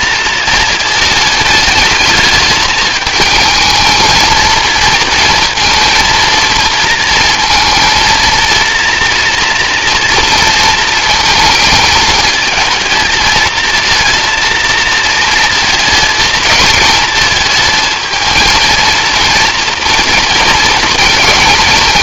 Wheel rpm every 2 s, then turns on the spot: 230, 210, 230, 230, 230, 230, 230, 230, 220, 230, 230.
none